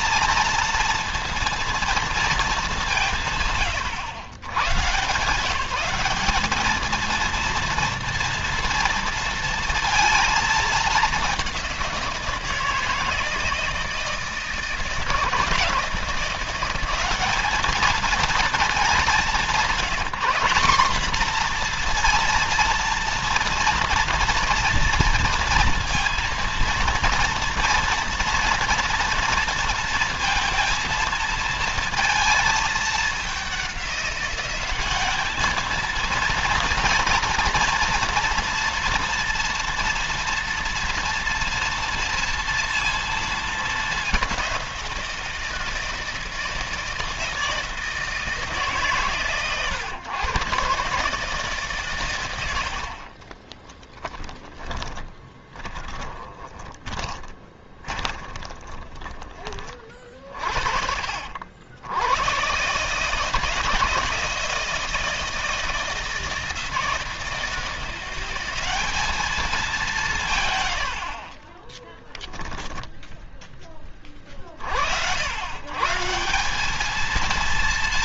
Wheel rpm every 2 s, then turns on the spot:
230, 200, 130, 220, 230, 210, 160, 160, 190, 210, 210, 230, 230, 230, 230, 230, 210, 200, 230, 230, 230, 230, 170, 160, 140, 130, 60, 10, 20, 20, 60, 140, 160, 160, 200, 90, 10, 70, 220.
54-60